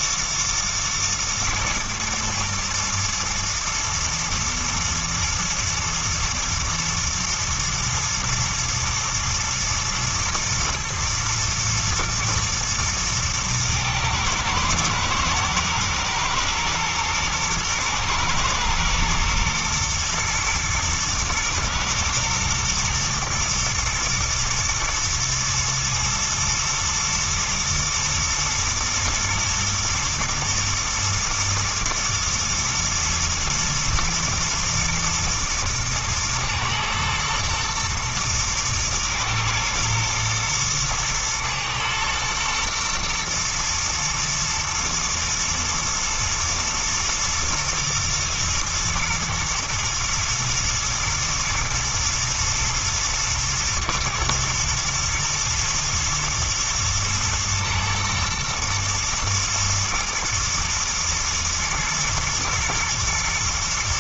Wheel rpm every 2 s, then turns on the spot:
110, 120, 110, 110, 120, 110, 120, 110, 120, 110, 110, 120, 110, 120, 120, 120, 120, 120, 120, 120, 120, 120, 110, 110, 110, 120, 120, 120, 110, 120, 120, 110.
none